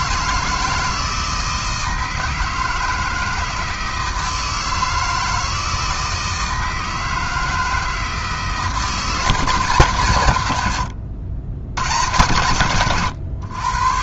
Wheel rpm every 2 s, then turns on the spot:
160, 160, 160, 160, 160, 110, 120.
none